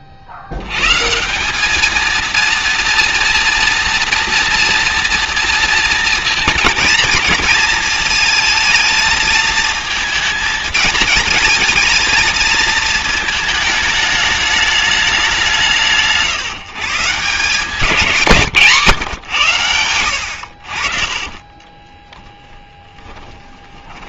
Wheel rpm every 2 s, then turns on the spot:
210, 230, 230, 220, 220, 220, 220, 160, 170, 100, 20, 30.
20-24